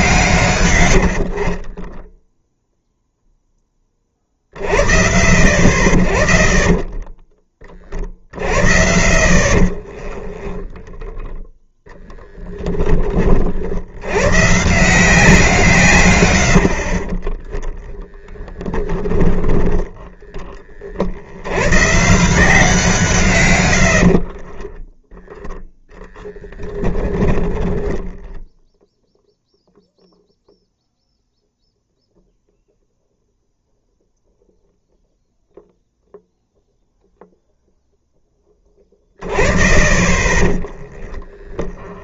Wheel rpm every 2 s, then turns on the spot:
140, 0, 50, 20, 50, 10, 10, 150, 60, 10, 10, 160, 20, 10, 0, 0, 0, 0, 0, 10, 20.
10-12 18-20 24-28 40-42